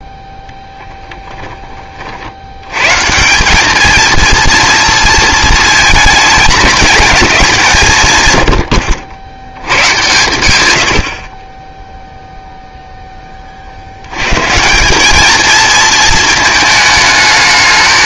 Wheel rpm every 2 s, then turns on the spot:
10, 100, 230, 220, 100, 100, 0, 160, 220.
0-2